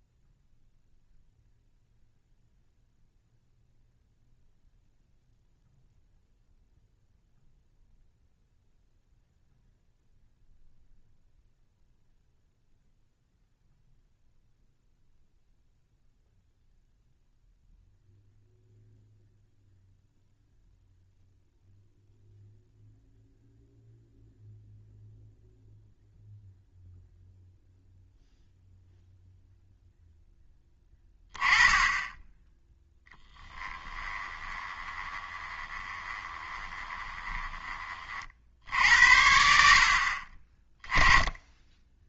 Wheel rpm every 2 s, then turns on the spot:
0, 0, 0, 0, 0, 0, 0, 0, 0, 0, 0, 0, 0, 0, 0, 10, 10, 20, 20, 60, 30.
34-38